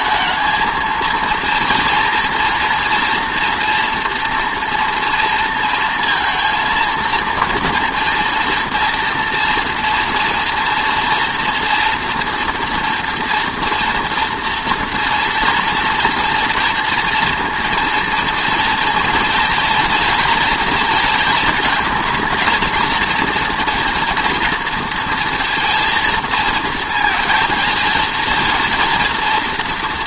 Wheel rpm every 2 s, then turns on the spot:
220, 230, 230, 230, 230, 230, 240, 240, 230, 230, 230, 230, 230, 220, 230.
none